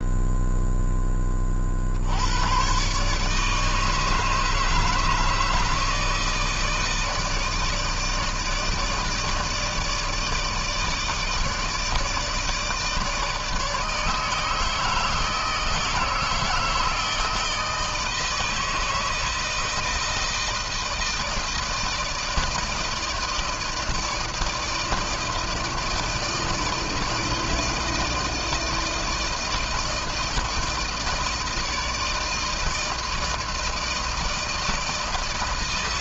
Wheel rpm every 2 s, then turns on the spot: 10, 120, 150, 160, 160, 160, 160, 160, 160, 160, 160, 160, 160, 160, 160, 160, 160, 160.
none